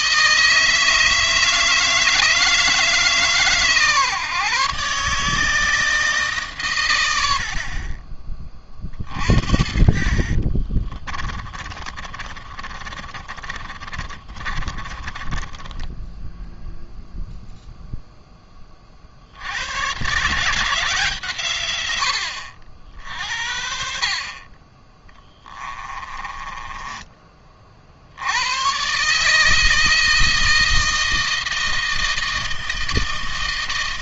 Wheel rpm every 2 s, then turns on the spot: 160, 160, 140, 130, 30, 40, 30, 30, 0, 20, 150, 70, 40, 20, 110, 160, 160.
10-16 26-28